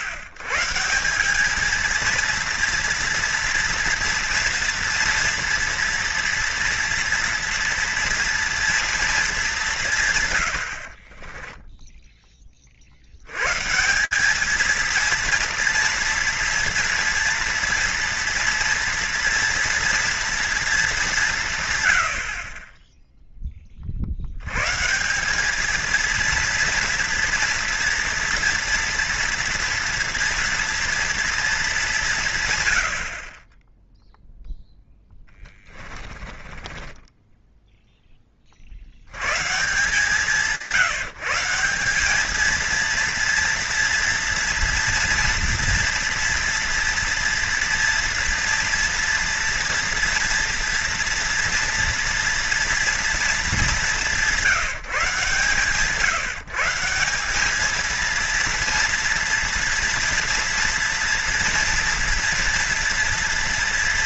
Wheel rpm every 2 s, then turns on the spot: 140, 230, 230, 230, 230, 100, 40, 220, 240, 230, 220, 30, 150, 230, 230, 230, 100, 0, 10, 30, 160, 220, 230, 230, 230, 230, 230, 160, 160, 230, 230, 230.
36-38